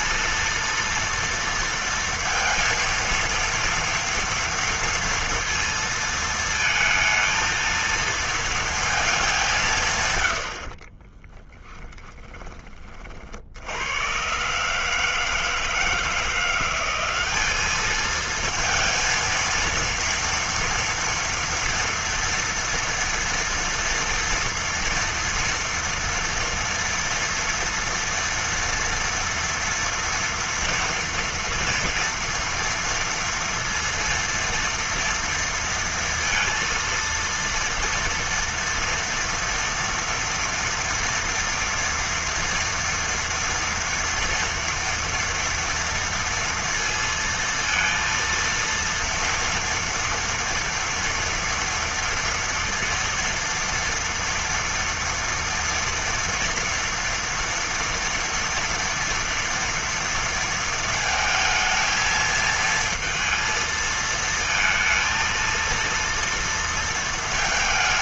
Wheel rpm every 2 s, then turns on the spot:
230, 230, 230, 230, 230, 110, 20, 120, 170, 220, 230, 230, 230, 230, 230, 230, 230, 230, 230, 230, 230, 230, 230, 230, 230, 230, 230, 230, 230, 230, 230, 220, 220, 230.
none